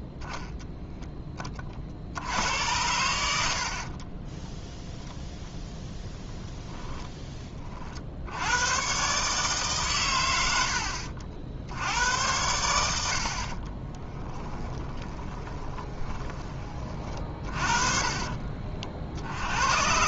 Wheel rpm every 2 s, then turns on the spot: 0, 90, 10, 20, 100, 80, 90, 10, 30, 40.
6-8 14-16